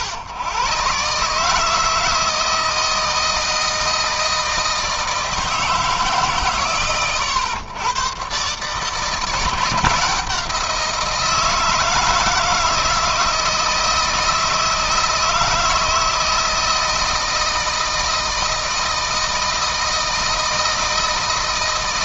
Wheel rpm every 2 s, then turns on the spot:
130, 160, 160, 120, 140, 170, 160, 160, 160, 160, 160.
none